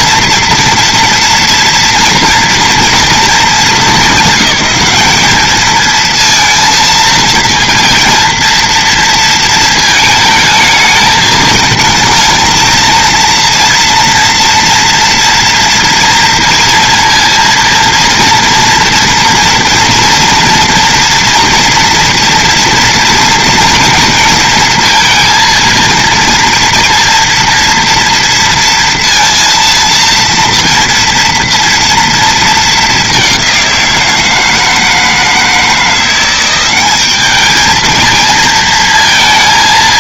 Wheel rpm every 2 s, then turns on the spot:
240, 240, 200, 230, 230, 220, 220, 230, 230, 240, 230, 230, 230, 230, 230, 230, 220, 160, 190, 230.
none